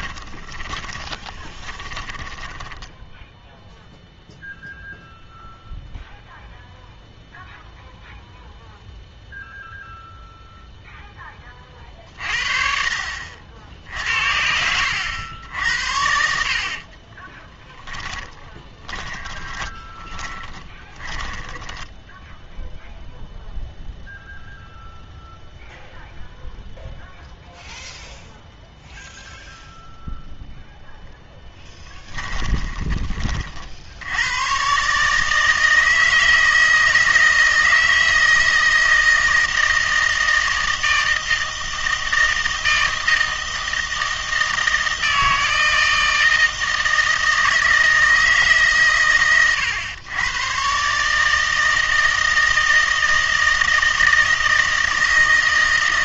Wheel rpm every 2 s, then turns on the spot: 30, 10, 0, 0, 0, 0, 50, 80, 50, 20, 20, 0, 0, 0, 0, 0, 20, 140, 160, 160, 160, 160, 160, 160, 140, 130, 160, 160.
0-4 16-22